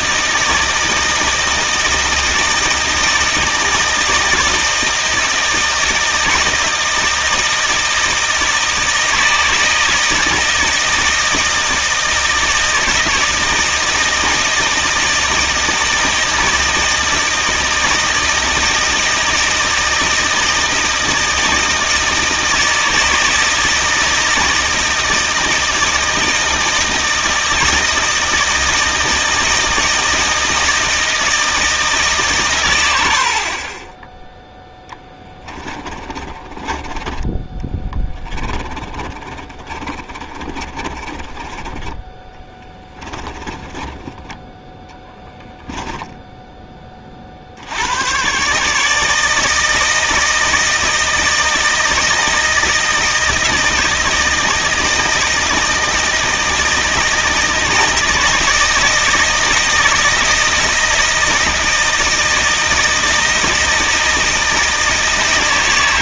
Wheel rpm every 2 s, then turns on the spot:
160, 160, 160, 160, 160, 160, 160, 160, 160, 160, 160, 160, 160, 160, 160, 160, 110, 10, 20, 20, 30, 20, 10, 10, 140, 160, 160, 160, 160, 160, 160, 160, 160.
36-46